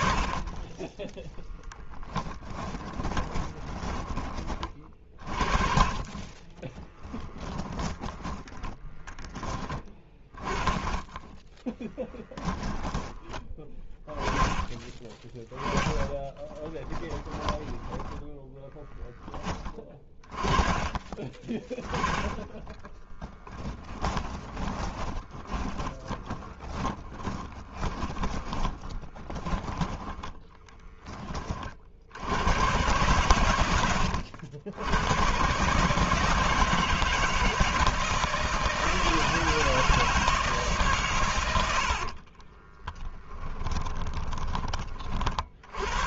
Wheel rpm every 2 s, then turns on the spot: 20, 20, 30, 20, 20, 20, 10, 20, 10, 10, 20, 10, 20, 10, 10, 20, 110, 110, 160, 160, 130, 10, 50.
2-4 6-8 10-12 16-18 22-30 42-44